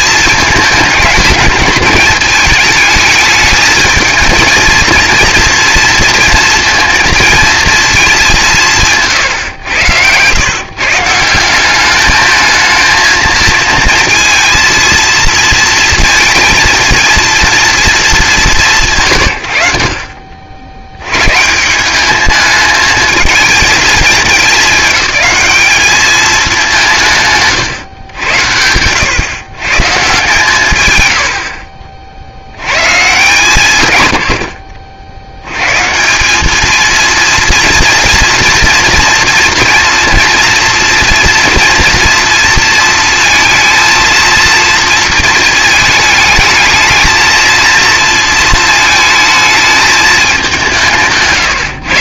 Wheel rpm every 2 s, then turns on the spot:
220, 210, 230, 230, 190, 130, 220, 230, 230, 190, 80, 210, 200, 200, 90, 130, 110, 60, 220, 240, 230, 230, 230, 220, 220, 180.
none